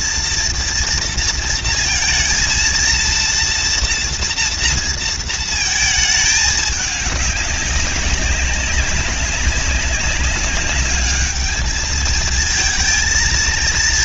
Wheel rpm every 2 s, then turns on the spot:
230, 230, 230, 210, 200, 200, 220.
none